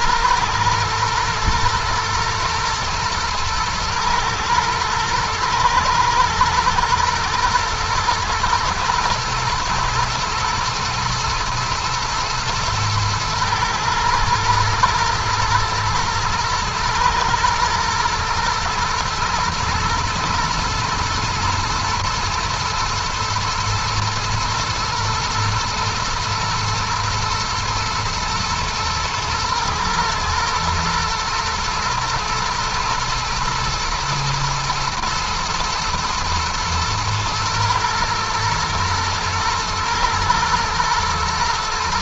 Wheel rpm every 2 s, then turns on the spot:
110, 110, 110, 110, 110, 110, 110, 120, 110, 120, 110, 110, 110, 110, 110, 110, 120, 110, 120, 110, 120.
none